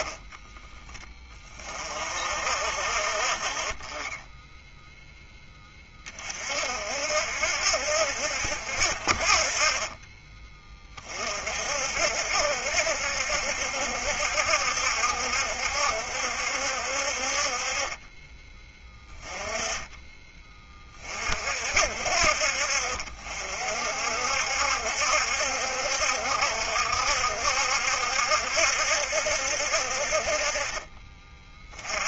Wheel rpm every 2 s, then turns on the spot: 10, 50, 10, 50, 60, 30, 60, 70, 60, 20, 30, 50, 70, 60, 70, 30.
none